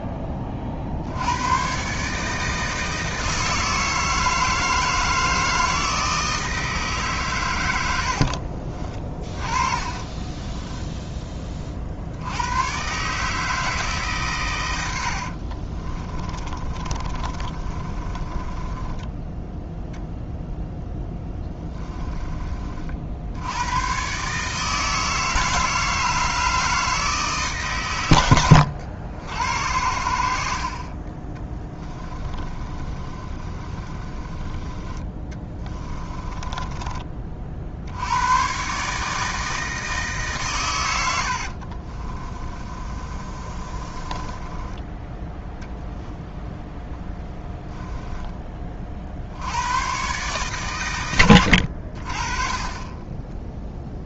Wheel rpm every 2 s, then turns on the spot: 50, 160, 160, 150, 30, 10, 120, 100, 30, 20, 10, 50, 160, 160, 90, 40, 30, 20, 20, 140, 110, 30, 20, 10, 40, 120, 30.
8-12 16-20 30-34 36-38 42-44 46-48